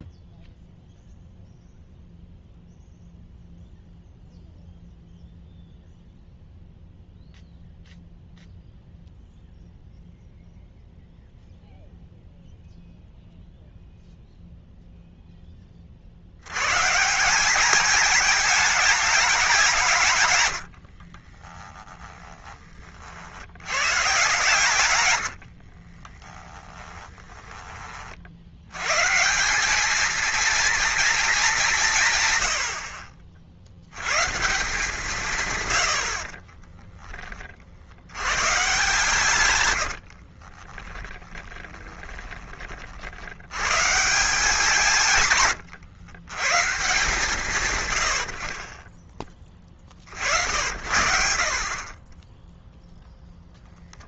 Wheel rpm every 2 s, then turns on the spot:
0, 0, 0, 0, 0, 0, 0, 0, 110, 220, 110, 40, 110, 10, 100, 230, 100, 160, 10, 140, 20, 50, 160, 140, 30, 90, 0.
20-22 26-28 40-42